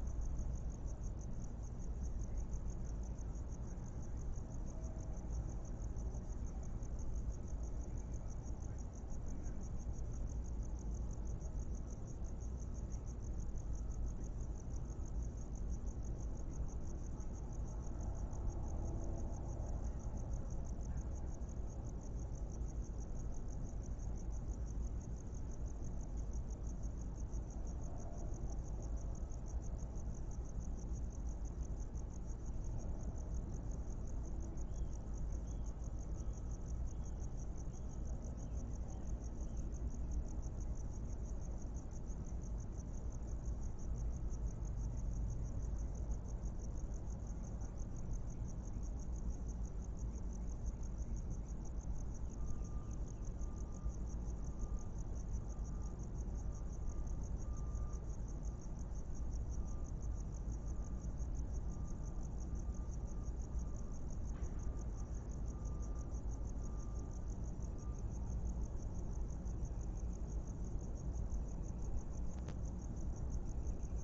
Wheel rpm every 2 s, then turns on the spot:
0, 0, 0, 0, 0, 0, 0, 0, 0, 0, 0, 0, 0, 0, 0, 0, 0, 0, 0, 0, 0, 0, 0, 0, 0, 0, 0, 0, 0, 0, 0, 0, 0, 0, 0, 0, 0.
none